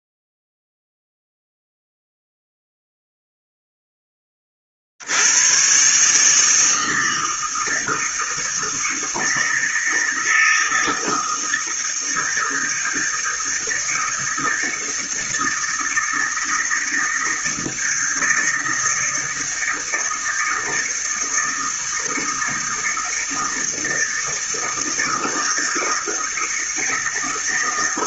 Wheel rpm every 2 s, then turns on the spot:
0, 0, 70, 160, 160, 160, 160, 160, 160, 160, 160, 160, 160, 160.
none